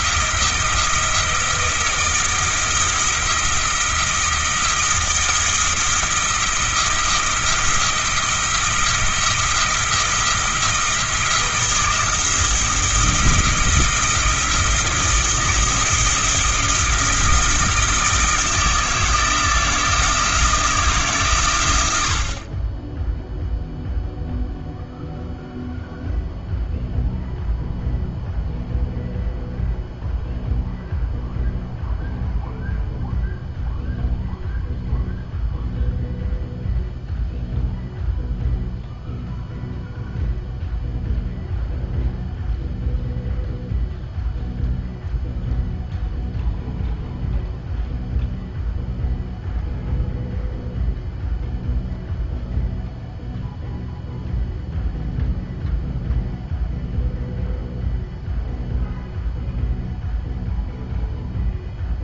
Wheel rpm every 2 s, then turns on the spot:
170, 170, 170, 170, 170, 170, 170, 170, 170, 160, 160, 20, 0, 0, 0, 0, 0, 0, 0, 0, 0, 0, 0, 0, 0, 0, 0, 0, 0, 0, 0.
none